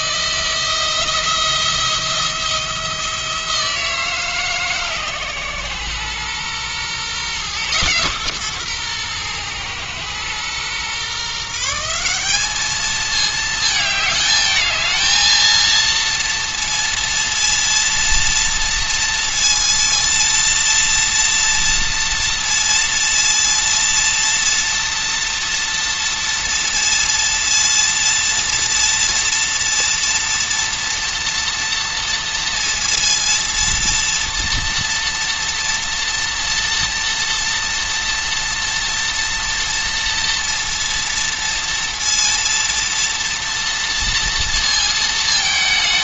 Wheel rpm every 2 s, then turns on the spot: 170, 170, 140, 120, 130, 120, 210, 220, 230, 230, 230, 230, 230, 230, 230, 230, 230, 240, 230, 230, 230, 230, 230.
none